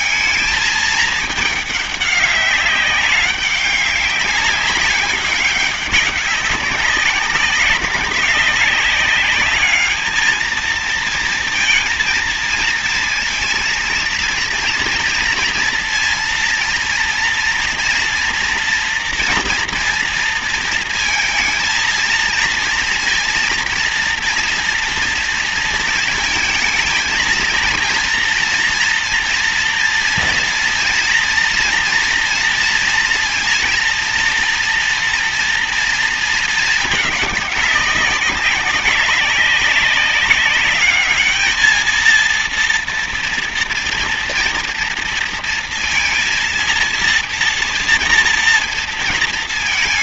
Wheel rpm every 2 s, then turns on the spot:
220, 200, 190, 190, 200, 220, 230, 230, 230, 230, 230, 230, 230, 220, 230, 230, 230, 230, 220, 200, 210, 230, 230, 230, 230.
none